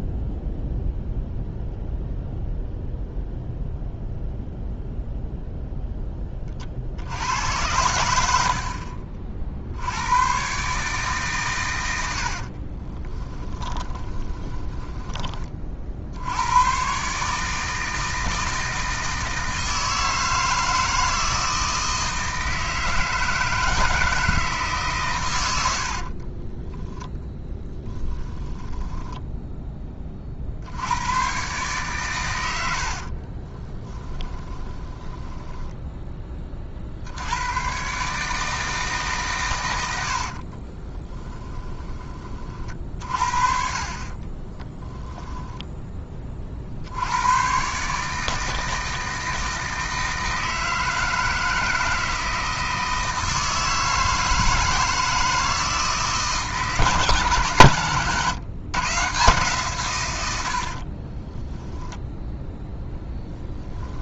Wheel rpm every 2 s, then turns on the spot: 0, 0, 0, 60, 50, 140, 30, 10, 120, 160, 160, 160, 140, 10, 10, 80, 80, 10, 60, 150, 30, 40, 10, 60, 160, 160, 160, 160, 150, 140, 50, 10.
12-16 26-30 32-36 40-42 44-46 60-62